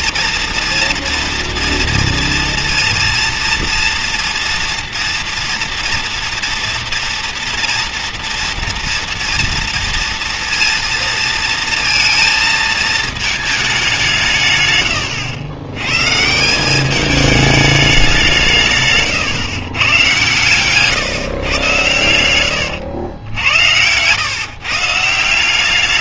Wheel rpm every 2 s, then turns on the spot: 230, 230, 230, 230, 230, 230, 220, 140, 170, 160, 130, 110, 140.
22-24